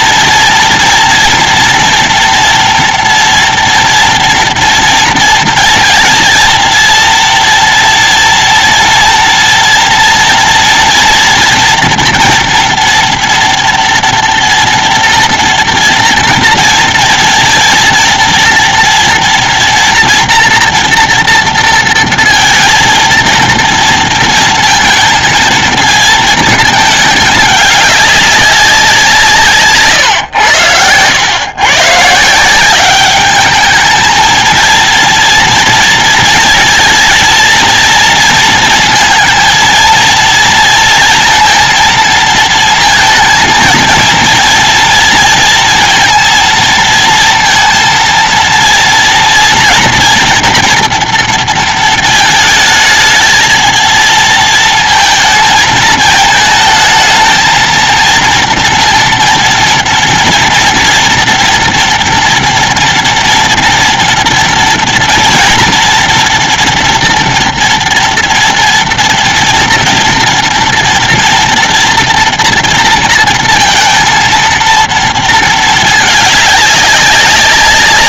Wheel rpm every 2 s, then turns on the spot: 230, 230, 230, 230, 230, 230, 230, 230, 230, 230, 230, 230, 230, 220, 200, 120, 140, 220, 230, 230, 230, 230, 230, 230, 230, 240, 220, 230, 220, 230, 230, 230, 230, 230, 230, 230, 240, 230, 210.
none